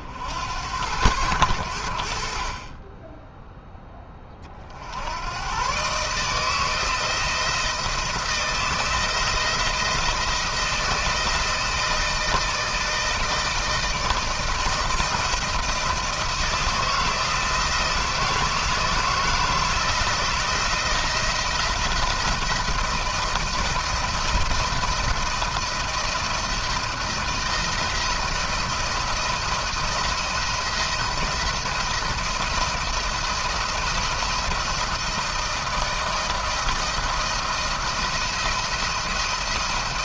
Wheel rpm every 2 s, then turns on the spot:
80, 30, 50, 160, 170, 170, 160, 170, 160, 160, 170, 170, 170, 170, 170, 170, 170, 170, 170, 170.
none